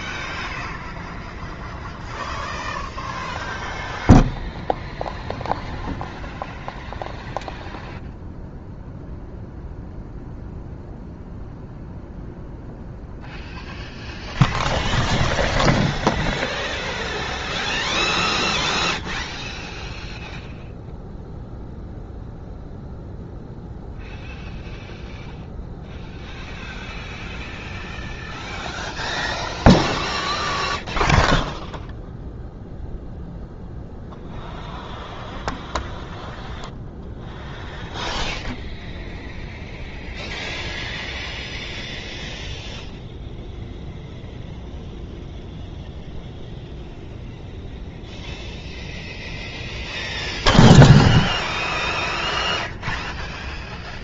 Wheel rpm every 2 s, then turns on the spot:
0, 0, 0, 0, 0, 0, 0, 0, 0, 0, 0, 0, 0, 0, 0, 0, 0, 0, 0, 0, 0, 0, 0, 0, 0, 0, 0.
none